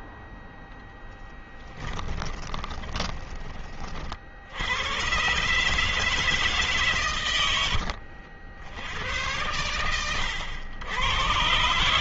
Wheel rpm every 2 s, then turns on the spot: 10, 20, 90, 140, 90, 100.
0-4